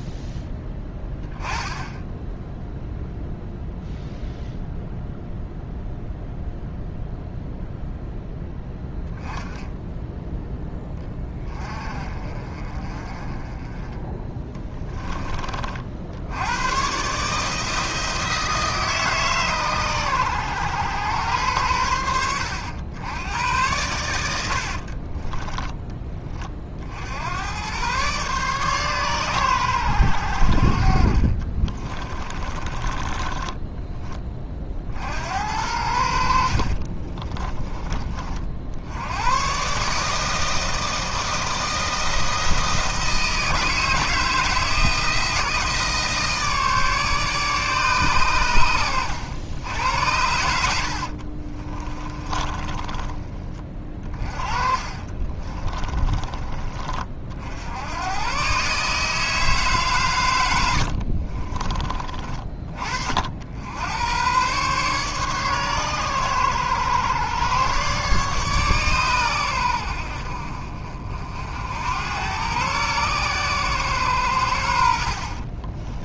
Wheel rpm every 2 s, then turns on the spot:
20, 0, 0, 0, 10, 20, 30, 20, 130, 150, 110, 100, 50, 60, 130, 50, 20, 60, 30, 80, 160, 160, 160, 150, 90, 60, 20, 40, 40, 150, 70, 50, 140, 120, 130, 50, 120, 80.
24-26 32-34 36-38 50-56 60-62